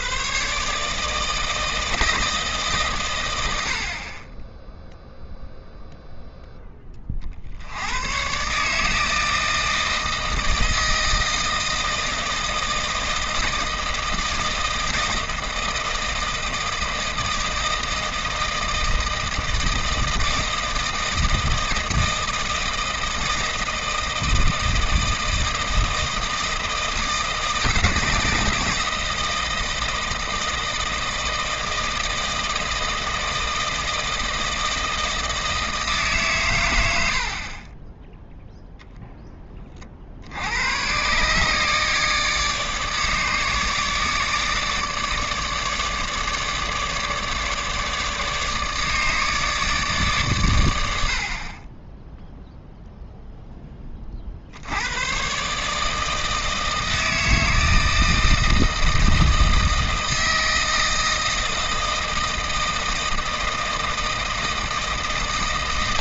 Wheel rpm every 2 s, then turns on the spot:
140, 150, 10, 10, 150, 160, 160, 160, 160, 160, 160, 160, 160, 160, 160, 160, 160, 160, 120, 0, 100, 150, 150, 150, 150, 110, 0, 80, 160, 160, 160, 160, 160.
none